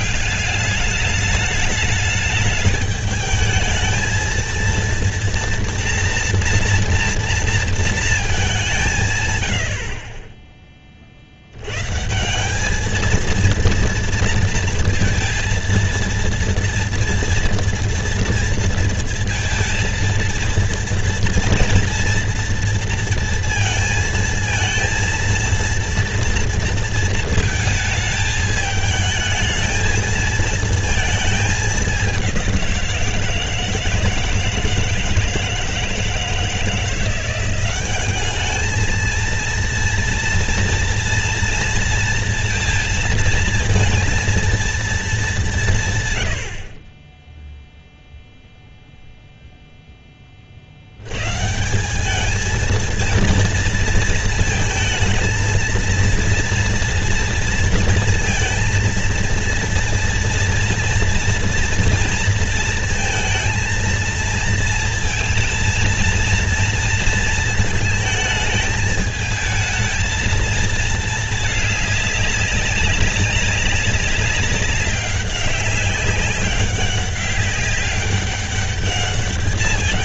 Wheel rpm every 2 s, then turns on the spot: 200, 210, 230, 240, 190, 20, 210, 230, 230, 230, 230, 230, 230, 230, 220, 230, 180, 160, 160, 210, 230, 230, 230, 50, 0, 60, 220, 220, 230, 230, 230, 230, 230, 230, 220, 230, 200, 190, 190, 200.
none